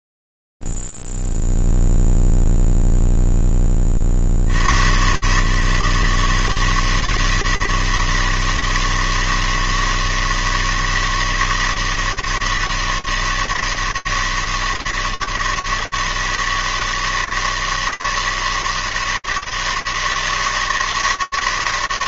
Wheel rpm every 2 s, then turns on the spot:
0, 0, 40, 150, 160, 160, 160, 150, 150, 160, 160.
none